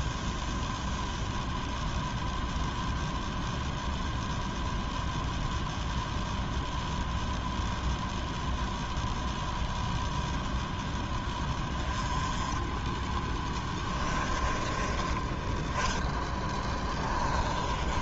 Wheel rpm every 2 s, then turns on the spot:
0, 0, 0, 0, 0, 10, 10, 20, 10.
16-18